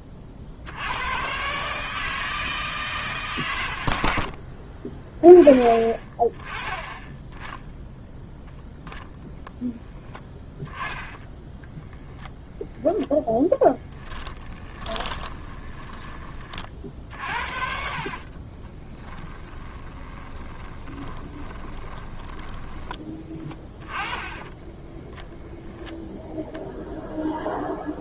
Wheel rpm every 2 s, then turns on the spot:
100, 160, 30, 20, 0, 10, 0, 20, 40, 10, 20, 20, 10, 0.
10-12 14-16 18-22 24-26